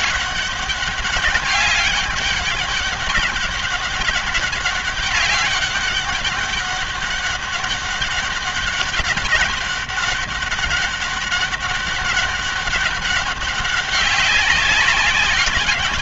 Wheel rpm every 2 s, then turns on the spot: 200, 200, 200, 200, 200, 200, 200, 190.
none